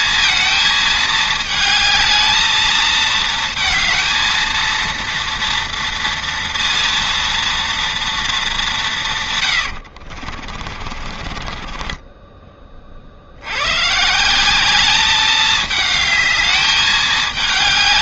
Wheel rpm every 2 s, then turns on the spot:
220, 220, 230, 230, 200, 40, 30, 200, 210.
10-12